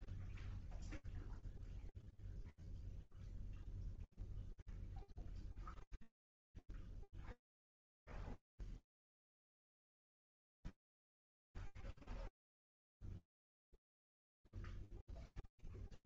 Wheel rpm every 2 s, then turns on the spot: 0, 0, 0, 0, 0, 0, 0, 0.
none